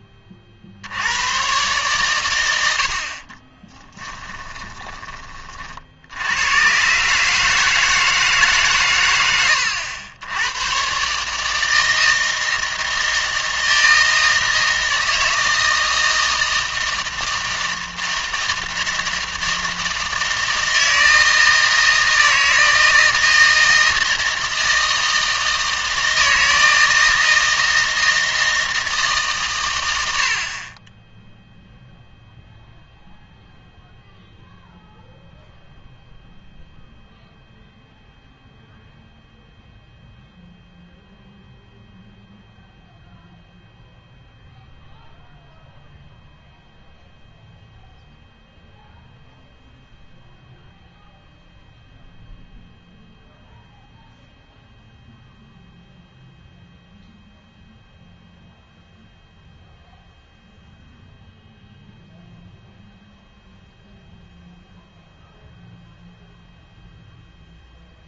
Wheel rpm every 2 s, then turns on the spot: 60, 90, 20, 120, 140, 110, 160, 160, 160, 160, 160, 160, 160, 160, 160, 30, 0, 0, 0, 0, 0, 0, 0, 0, 0, 0, 0, 0, 0, 0, 0, 0, 0, 0.
4-6